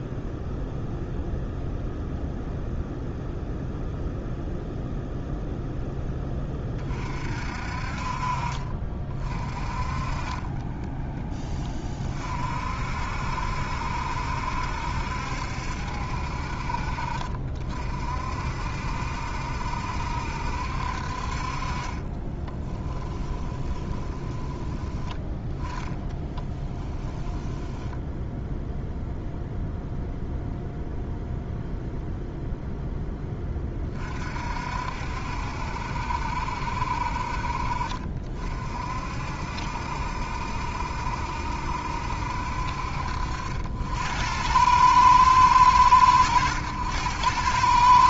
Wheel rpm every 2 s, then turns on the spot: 0, 0, 0, 20, 40, 20, 50, 70, 50, 60, 60, 10, 10, 10, 0, 0, 0, 50, 60, 50, 70, 60, 90, 90.
10-12 22-24 26-28